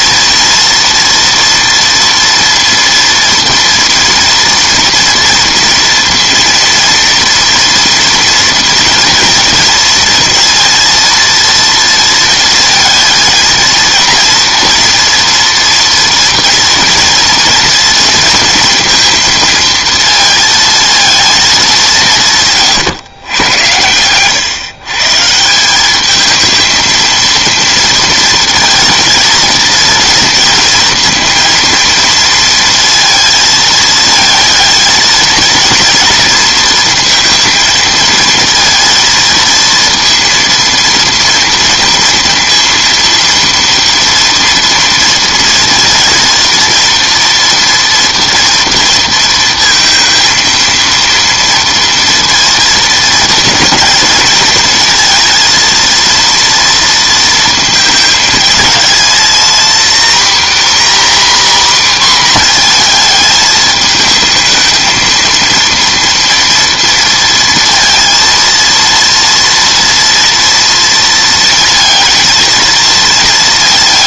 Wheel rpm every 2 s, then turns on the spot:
230, 230, 230, 230, 230, 230, 230, 230, 230, 230, 230, 140, 130, 220, 230, 230, 230, 220, 230, 230, 230, 230, 230, 230, 230, 230, 230, 230, 230, 220, 250, 240, 220, 230, 230, 230, 230.
none